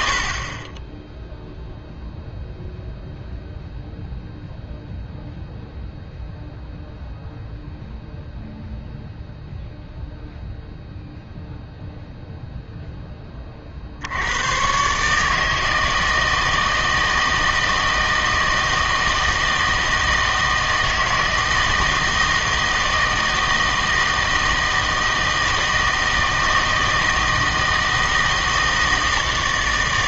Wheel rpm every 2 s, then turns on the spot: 30, 0, 0, 0, 0, 0, 0, 120, 160, 160, 160, 160, 160, 160, 160.
none